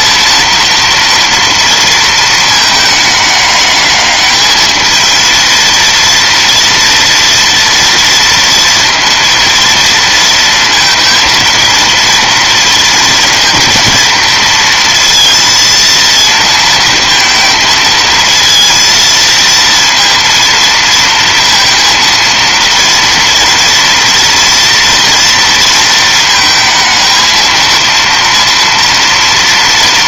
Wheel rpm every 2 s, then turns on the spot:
230, 220, 220, 240, 230, 230, 230, 230, 230, 230, 230, 230, 230, 220, 230.
none